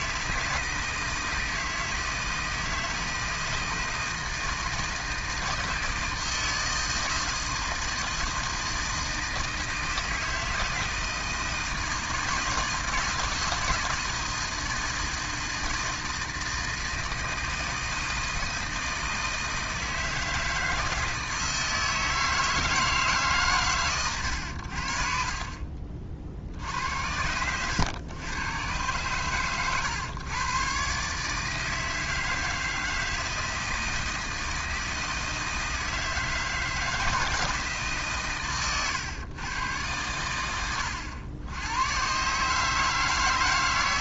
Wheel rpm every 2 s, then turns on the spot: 160, 160, 160, 160, 160, 160, 160, 160, 160, 160, 160, 160, 100, 60, 110, 120, 160, 160, 160, 130, 90, 140.
none